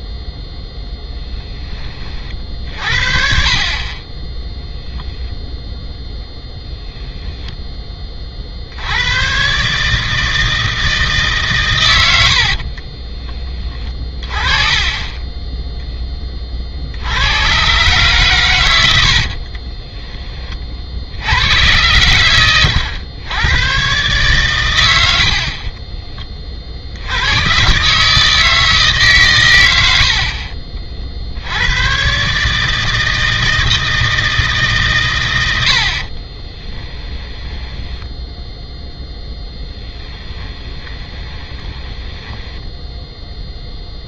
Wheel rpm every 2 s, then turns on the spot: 0, 50, 0, 0, 70, 160, 50, 20, 50, 100, 40, 100, 110, 60, 150, 40, 150, 160, 30, 0, 10, 10.
12-14 36-38 40-44